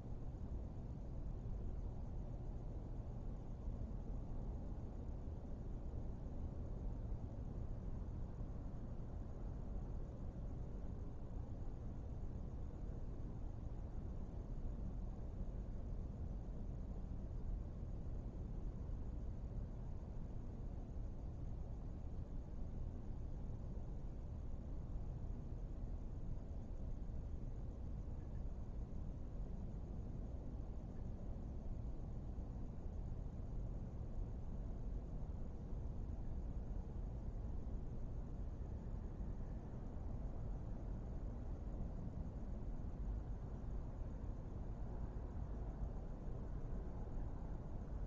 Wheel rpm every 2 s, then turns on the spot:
0, 0, 0, 0, 0, 0, 0, 0, 0, 0, 0, 0, 0, 0, 0, 0, 0, 0, 0, 0, 0, 0, 0, 0.
none